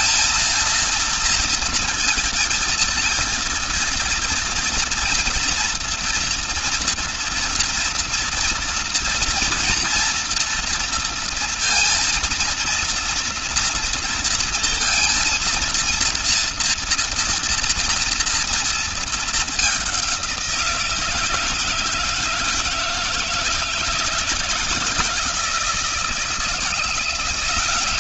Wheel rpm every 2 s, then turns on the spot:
230, 230, 230, 230, 230, 230, 230, 230, 230, 220, 170, 160, 170, 170.
none